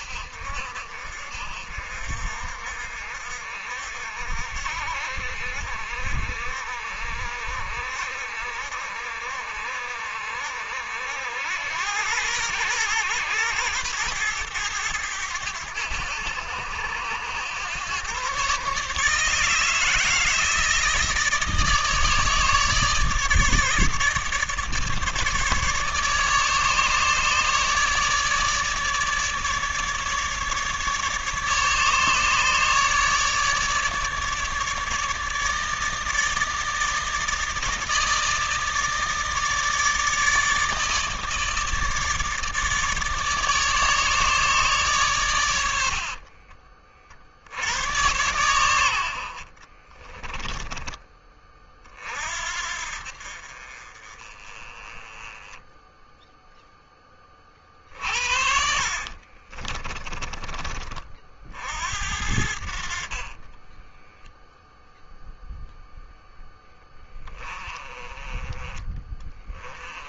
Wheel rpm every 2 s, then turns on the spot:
60, 60, 60, 60, 60, 70, 110, 110, 90, 130, 160, 150, 150, 150, 150, 150, 150, 150, 160, 160, 160, 150, 150, 40, 100, 20, 60, 20, 10, 60, 30, 70, 0, 10, 20.
46-48 50-52 58-60 62-64 66-70